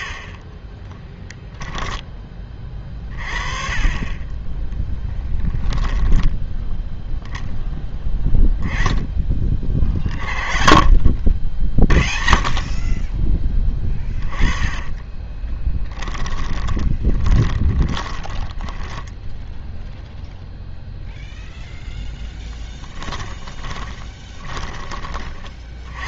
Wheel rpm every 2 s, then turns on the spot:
20, 30, 10, 10, 10, 40, 40, 20, 20, 10, 0, 10, 20.
0-2 14-20 22-26